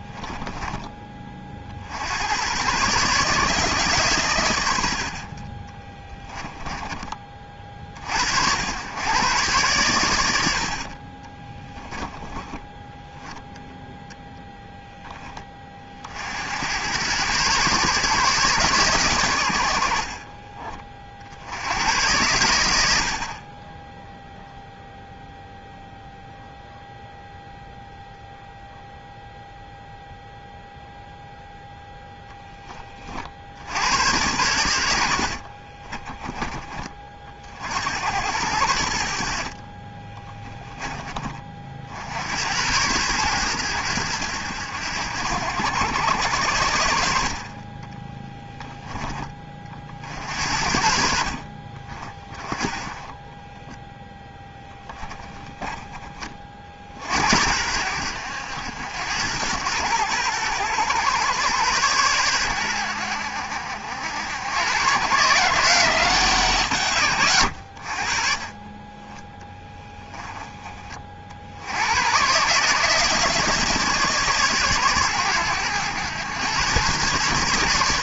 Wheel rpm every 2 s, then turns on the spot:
10, 110, 90, 10, 90, 70, 10, 0, 80, 140, 40, 90, 0, 0, 0, 0, 20, 80, 30, 80, 20, 90, 90, 90, 20, 60, 30, 10, 40, 80, 110, 90, 100, 130, 30, 30, 140, 130, 110.
6-8 40-42 48-50 54-56